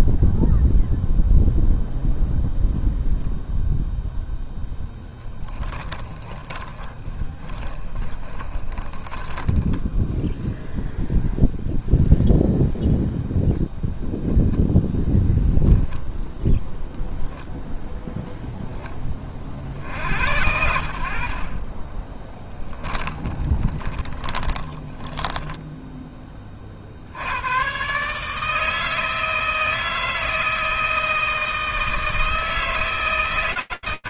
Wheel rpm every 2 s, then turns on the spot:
0, 0, 10, 20, 20, 0, 0, 0, 0, 70, 20, 20, 20, 150, 160, 160, 160.
4-10 20-24